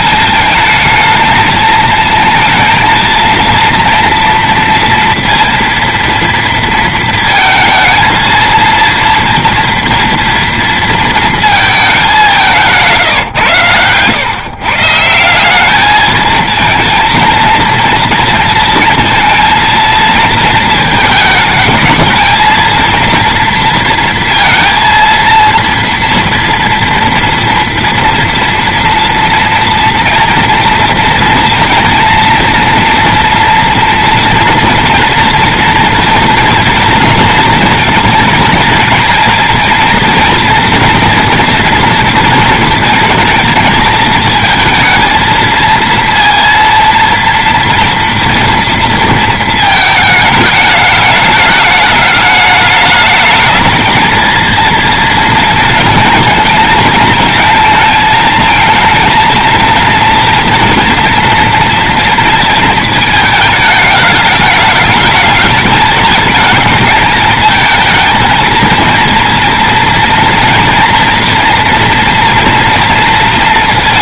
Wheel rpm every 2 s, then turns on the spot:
220, 230, 230, 230, 230, 230, 140, 160, 230, 230, 220, 230, 230, 230, 240, 230, 230, 230, 230, 230, 230, 230, 220, 230, 230, 210, 220, 230, 220, 230, 230, 220, 220, 220, 230, 230, 230.
12-14